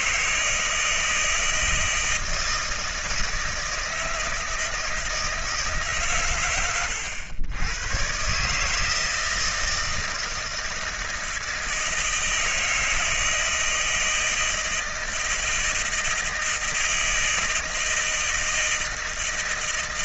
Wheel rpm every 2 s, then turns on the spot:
80, 160, 160, 150, 110, 160, 160, 160, 160, 160.
none